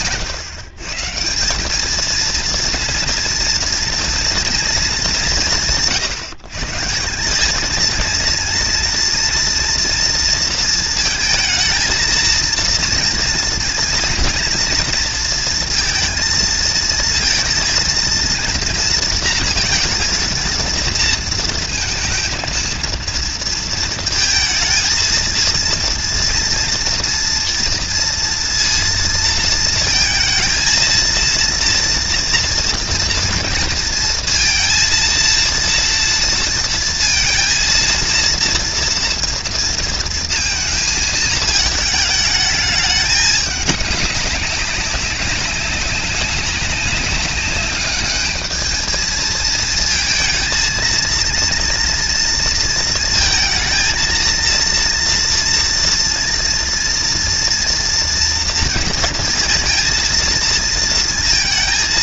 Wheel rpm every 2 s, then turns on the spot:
150, 230, 170, 160, 230, 230, 230, 230, 220, 220, 220, 230, 220, 230, 230, 230, 230, 230, 230, 230, 220, 210, 190, 200, 220, 220, 230, 230, 240, 230, 230.
none